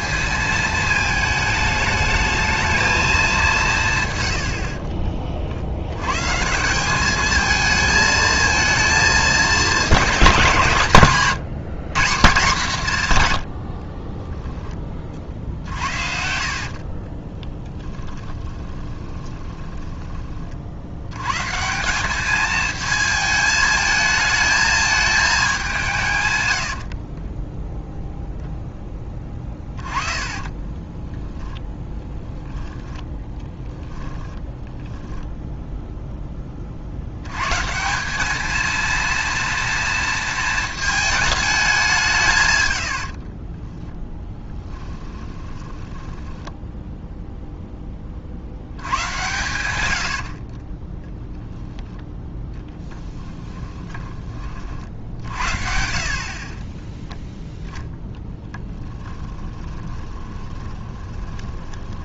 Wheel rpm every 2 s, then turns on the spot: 220, 220, 60, 200, 220, 150, 150, 20, 40, 20, 80, 220, 220, 60, 10, 20, 20, 0, 50, 230, 220, 90, 10, 0, 90, 20, 10, 50, 10, 20, 20.
4-6 16-20 26-28 30-32 42-46 50-54 56-62